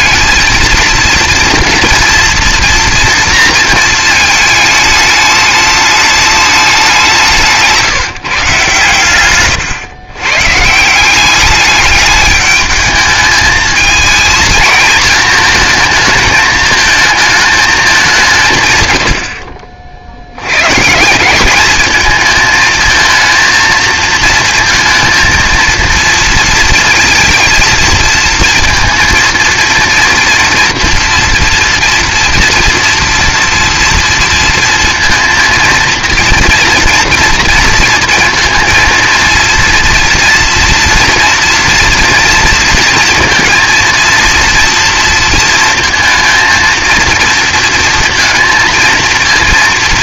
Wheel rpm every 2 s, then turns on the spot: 230, 230, 220, 210, 140, 140, 210, 230, 220, 140, 120, 220, 230, 230, 230, 230, 230, 230, 230, 230, 230, 230, 230, 230, 230.
none